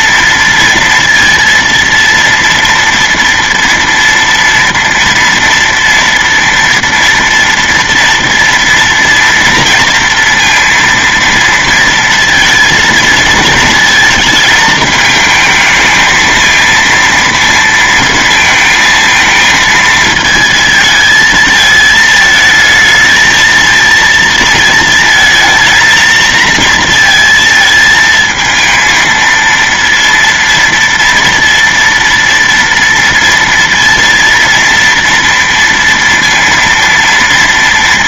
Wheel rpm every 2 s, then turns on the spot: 230, 230, 230, 240, 230, 230, 230, 220, 230, 230, 220, 220, 230, 230, 230, 230, 230, 230, 230.
none